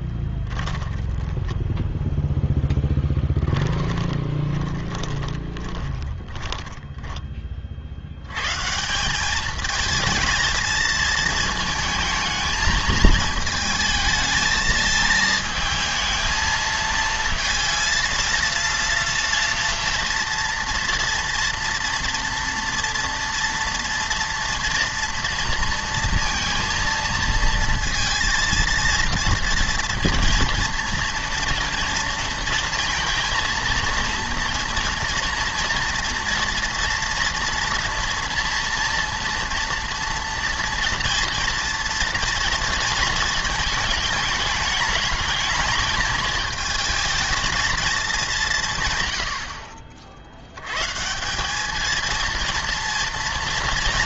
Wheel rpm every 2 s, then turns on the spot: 10, 0, 20, 10, 140, 220, 220, 220, 220, 230, 230, 240, 240, 230, 230, 230, 230, 230, 230, 230, 230, 230, 210, 220, 160, 110, 230.
0-2 4-8